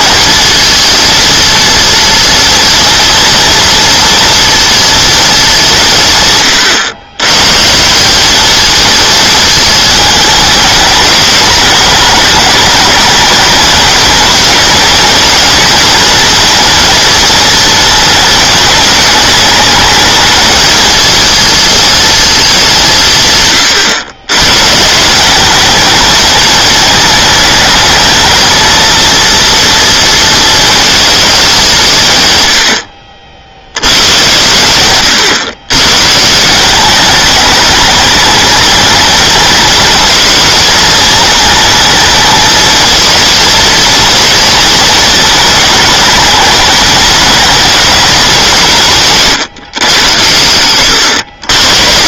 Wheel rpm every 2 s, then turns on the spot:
230, 230, 230, 120, 220, 210, 210, 220, 230, 220, 220, 190, 150, 220, 230, 220, 110, 110, 190, 220, 220, 230, 230, 210, 160, 90.
none